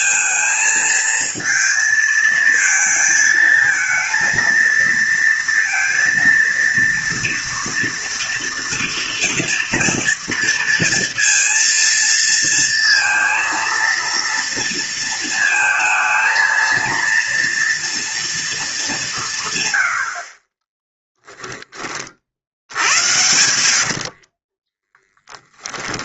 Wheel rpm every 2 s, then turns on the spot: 230, 220, 220, 230, 240, 230, 230, 230, 230, 210, 20, 80, 20.
24-26